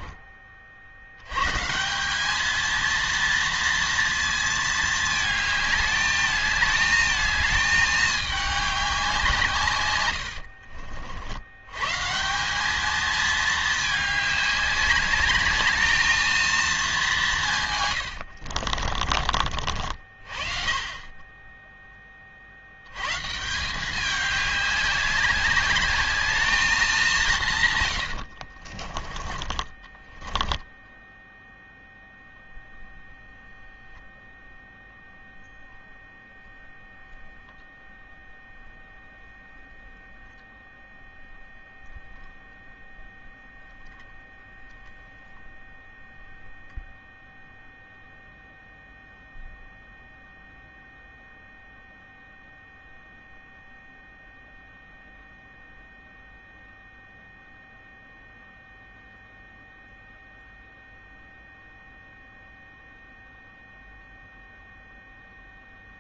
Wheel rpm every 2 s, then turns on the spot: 140, 230, 220, 220, 160, 80, 220, 210, 160, 40, 20, 150, 200, 180, 30, 0, 0, 0, 0, 0, 0, 0, 0, 0, 0, 0, 0, 0, 0, 0, 0, 0, 0.
28-30